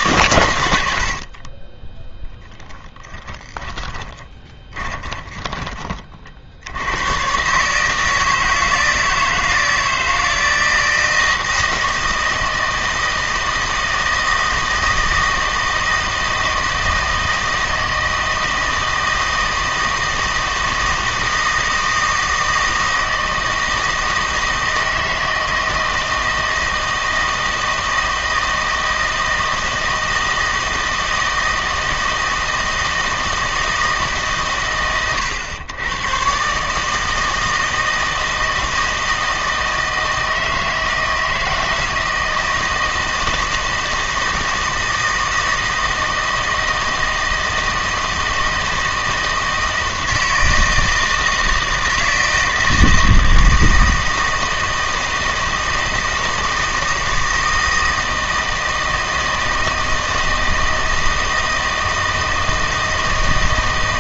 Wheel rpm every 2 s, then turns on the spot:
90, 10, 20, 90, 160, 160, 160, 160, 160, 160, 160, 160, 160, 160, 160, 160, 160, 120, 150, 160, 160, 160, 160, 160, 160, 160, 160, 160, 160, 160, 160, 160.
2-6